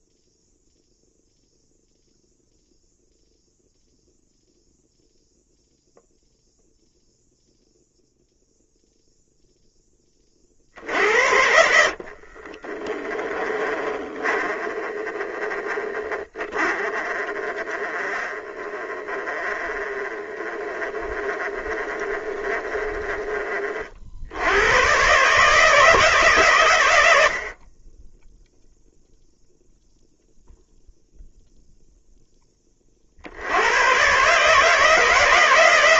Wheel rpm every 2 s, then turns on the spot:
0, 0, 0, 0, 0, 60, 30, 20, 30, 20, 20, 20, 120, 120, 0, 0, 30, 150.
12-14 16-22